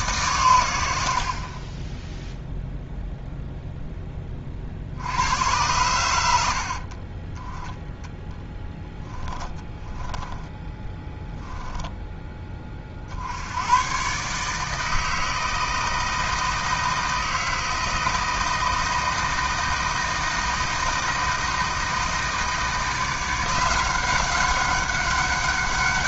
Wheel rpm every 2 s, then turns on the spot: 70, 0, 50, 60, 10, 10, 30, 160, 160, 160, 160, 160, 190.
8-12